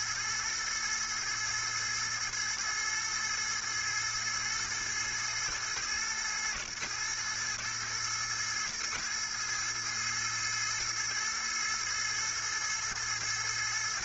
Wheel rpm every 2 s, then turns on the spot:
110, 110, 110, 120, 110, 110, 110.
none